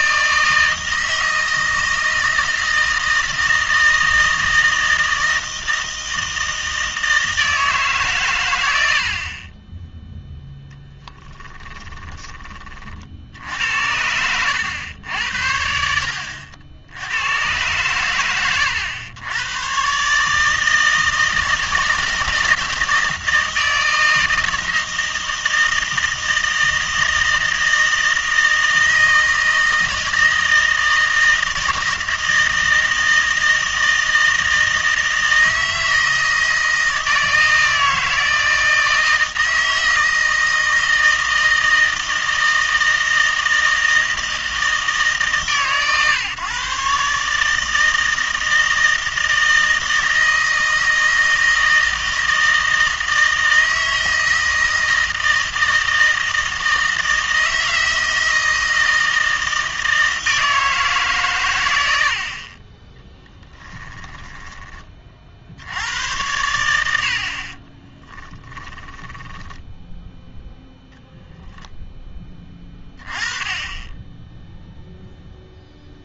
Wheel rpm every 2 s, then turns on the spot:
160, 160, 160, 160, 90, 10, 50, 100, 80, 110, 160, 160, 160, 160, 160, 160, 160, 160, 160, 160, 160, 160, 160, 140, 160, 160, 160, 160, 160, 160, 150, 30, 20, 90, 20, 0, 20, 0.
10-12 64-66 68-70